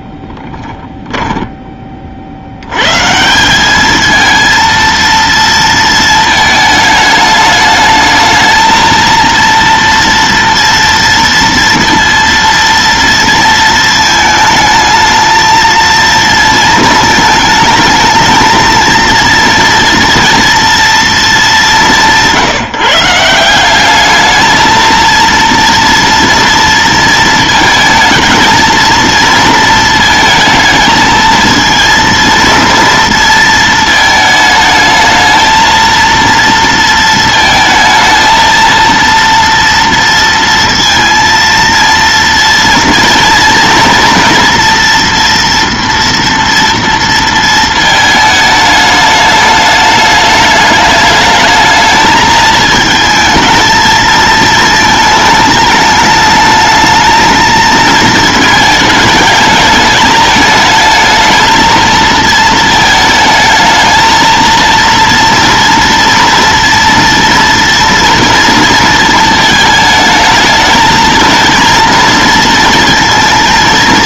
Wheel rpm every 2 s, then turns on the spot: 10, 100, 230, 220, 220, 230, 230, 220, 220, 220, 230, 160, 220, 230, 230, 220, 230, 220, 230, 230, 230, 230, 230, 230, 210, 210, 220, 220, 210, 220, 220, 220, 230, 230, 230, 220, 230.
0-2